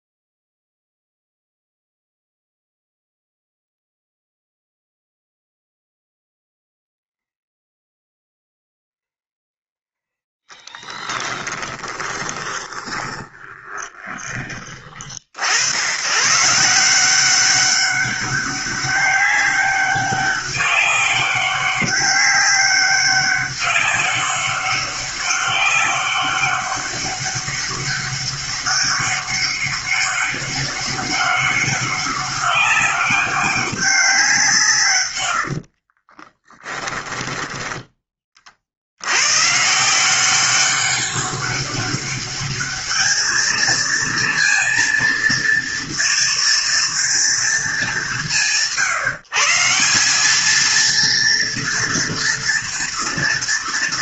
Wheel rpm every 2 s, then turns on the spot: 0, 0, 0, 0, 0, 10, 20, 40, 170, 200, 200, 200, 200, 200, 200, 200, 200, 140, 20, 80, 200, 210, 230, 230, 140, 230, 230.
10-14 36-38